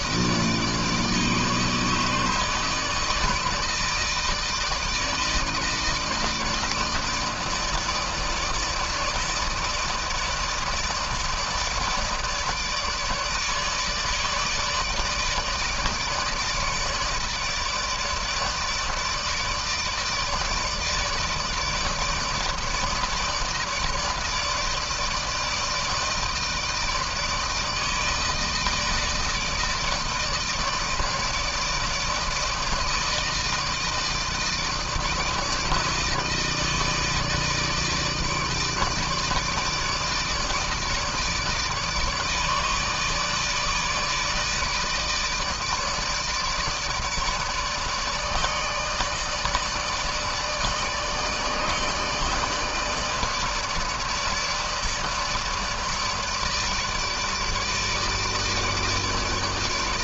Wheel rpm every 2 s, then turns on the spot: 160, 150, 160, 160, 160, 160, 150, 150, 160, 160, 160, 160, 160, 160, 160, 160, 160, 160, 160, 160, 160, 150, 150, 150, 150, 150, 150, 150, 150, 150.
none